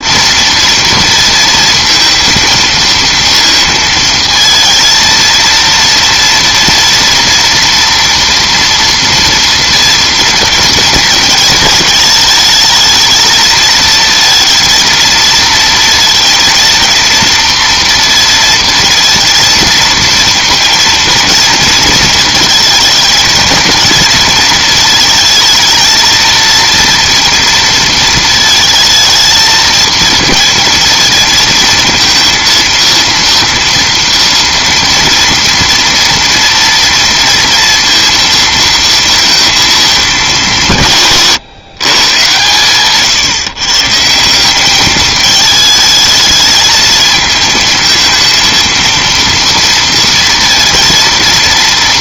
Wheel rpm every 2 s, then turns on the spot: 230, 230, 230, 230, 240, 230, 220, 230, 230, 230, 230, 230, 220, 230, 220, 230, 230, 230, 230, 230, 140, 130, 210, 220, 230, 230.
none